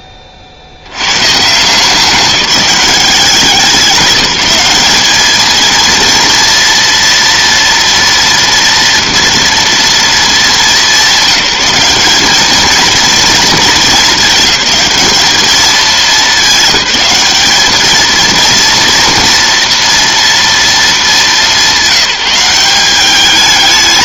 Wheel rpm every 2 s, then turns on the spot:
60, 190, 200, 240, 230, 210, 220, 210, 210, 230, 230, 190.
none